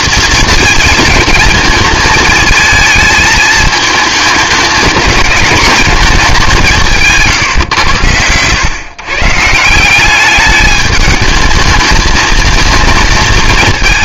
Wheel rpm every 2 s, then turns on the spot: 220, 220, 220, 170, 110, 210, 220.
none